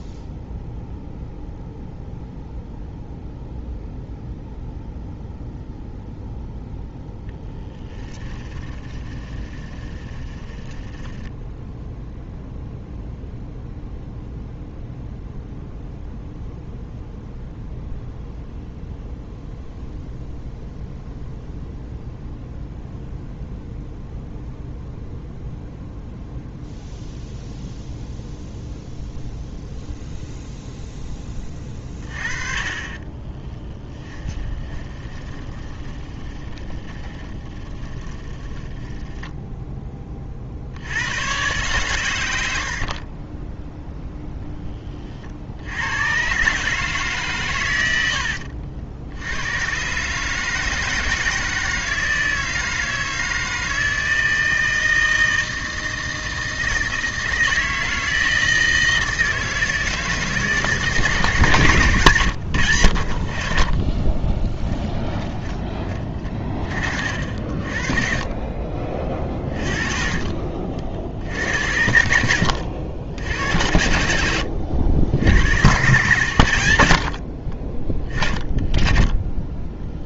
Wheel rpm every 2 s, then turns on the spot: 0, 0, 0, 0, 30, 10, 0, 0, 0, 0, 0, 0, 0, 0, 0, 0, 30, 20, 20, 10, 70, 60, 20, 150, 70, 160, 160, 160, 160, 160, 150, 90, 20, 40, 30, 50, 80, 70, 80, 20.
8-12 32-40 64-66 74-76